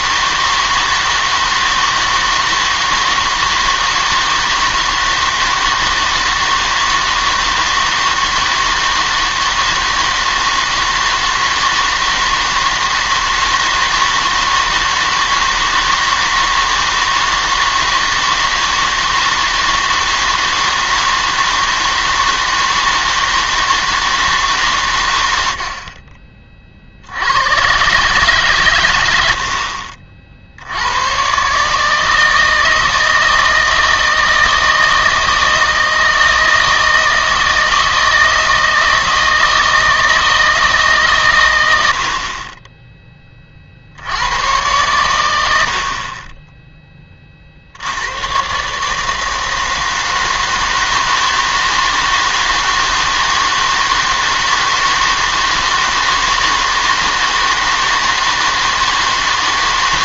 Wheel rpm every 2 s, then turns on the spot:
160, 160, 160, 160, 160, 160, 160, 160, 160, 160, 160, 160, 140, 40, 130, 70, 160, 160, 160, 160, 150, 20, 110, 20, 140, 160, 160, 160, 160, 160.
none